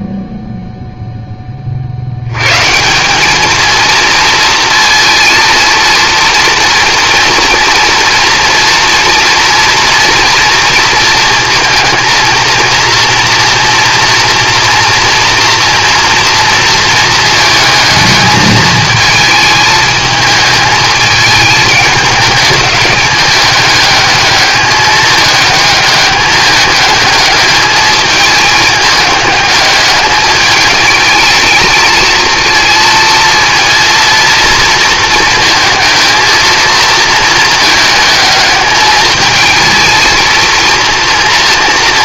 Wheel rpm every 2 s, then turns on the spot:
0, 170, 230, 230, 230, 230, 230, 240, 230, 220, 220, 200, 210, 210, 210, 210, 230, 230, 220, 220, 230.
none